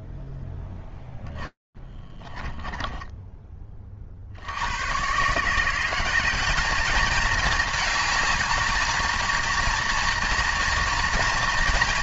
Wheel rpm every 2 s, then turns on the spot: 10, 10, 90, 210, 220, 230.
2-4